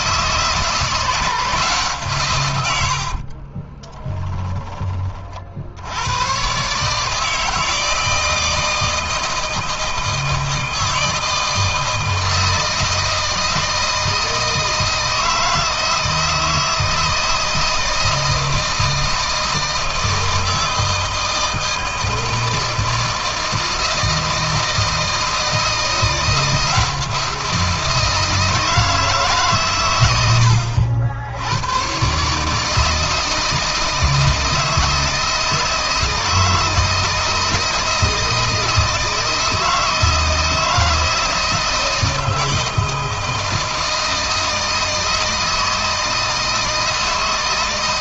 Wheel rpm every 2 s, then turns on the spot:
160, 90, 30, 130, 160, 160, 160, 160, 160, 160, 160, 160, 160, 170, 160, 80, 150, 160, 160, 160, 160, 160, 160, 160.
2-4